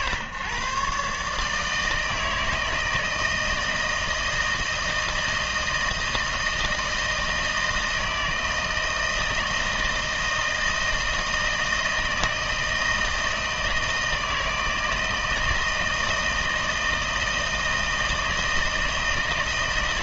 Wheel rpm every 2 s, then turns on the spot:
130, 160, 160, 160, 160, 160, 160, 160, 160, 160.
none